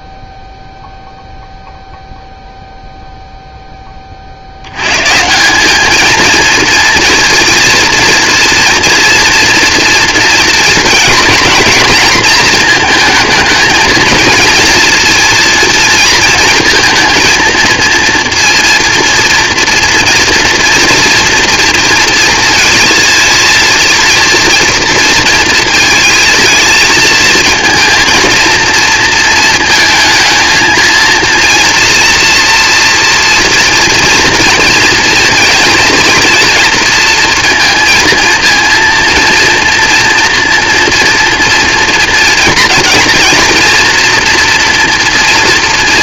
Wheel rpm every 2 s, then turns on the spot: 0, 0, 80, 230, 230, 220, 220, 230, 230, 230, 230, 230, 230, 220, 230, 230, 230, 230, 230, 230, 240, 230, 230.
none